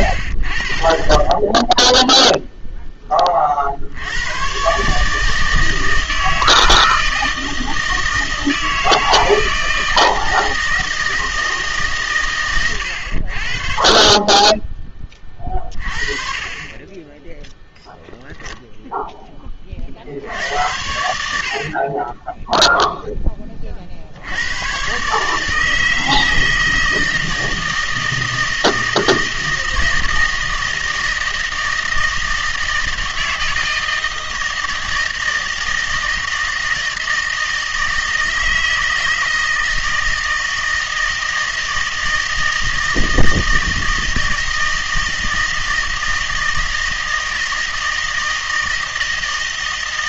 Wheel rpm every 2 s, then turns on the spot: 50, 0, 120, 160, 160, 160, 110, 10, 30, 0, 80, 0, 110, 160, 160, 160, 160, 160, 160, 160, 160, 160, 160, 160, 160.
none